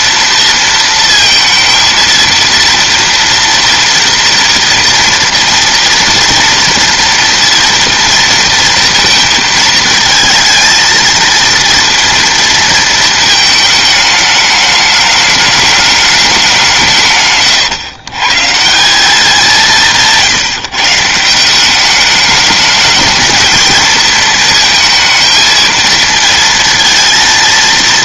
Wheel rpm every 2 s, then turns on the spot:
230, 230, 230, 230, 230, 230, 230, 210, 180, 160, 150, 210, 220, 230.
none